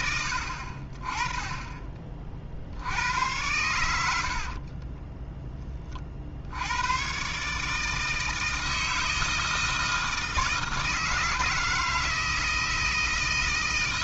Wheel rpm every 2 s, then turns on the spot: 20, 110, 30, 110, 160, 160, 160.
4-6